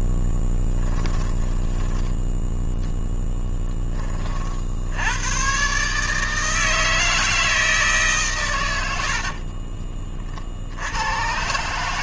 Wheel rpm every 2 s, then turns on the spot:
10, 10, 30, 150, 140, 40.
2-4